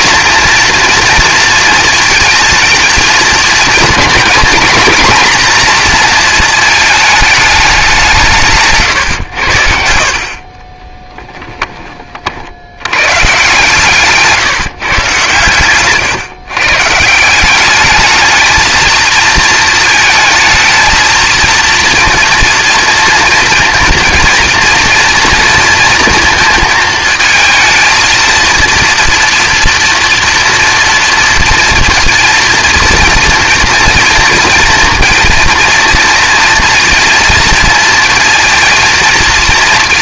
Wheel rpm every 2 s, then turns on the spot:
230, 230, 250, 220, 150, 30, 70, 150, 140, 220, 220, 230, 230, 230, 230, 230, 230, 230, 230, 230.
8-12